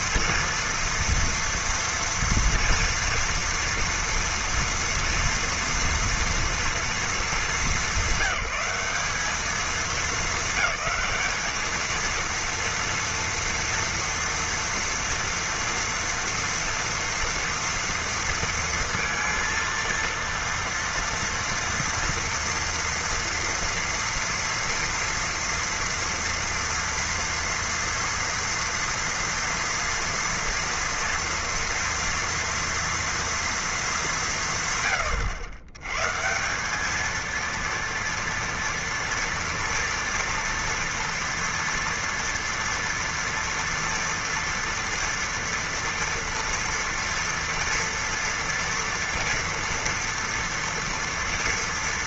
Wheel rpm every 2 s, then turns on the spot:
230, 240, 230, 230, 190, 220, 230, 230, 240, 230, 230, 230, 230, 230, 230, 230, 230, 140, 190, 230, 230, 230, 230, 240, 240, 230.
none